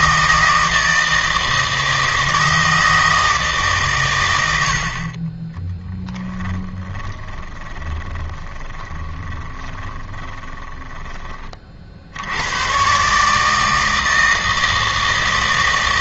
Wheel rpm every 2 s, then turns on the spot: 160, 160, 80, 20, 10, 20, 120, 160.
6-10